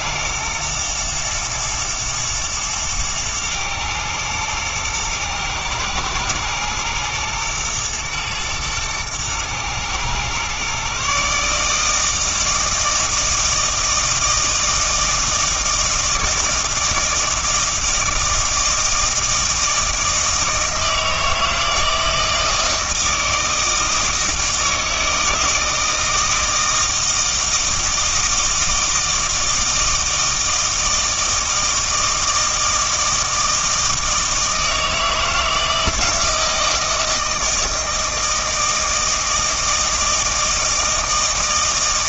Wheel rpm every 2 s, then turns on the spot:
120, 120, 110, 120, 110, 130, 160, 160, 160, 160, 160, 160, 160, 160, 160, 160, 160, 160, 160, 160, 160.
none